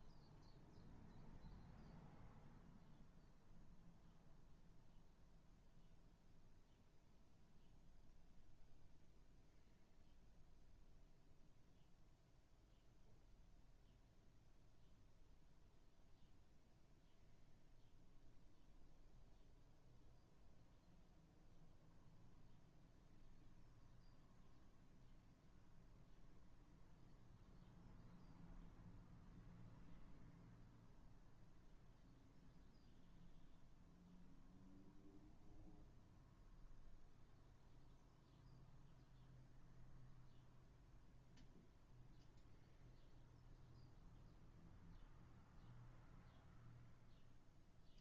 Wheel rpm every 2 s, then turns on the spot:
0, 0, 0, 0, 0, 0, 0, 0, 0, 0, 0, 0, 0, 0, 0, 0, 0, 0, 0, 0, 0, 0, 0, 0.
none